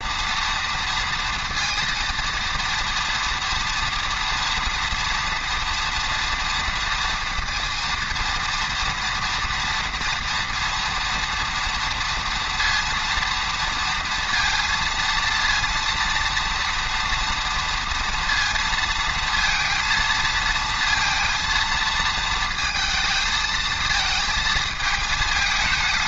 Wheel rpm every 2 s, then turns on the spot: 230, 230, 230, 230, 230, 230, 230, 230, 230, 230, 230, 220, 220.
none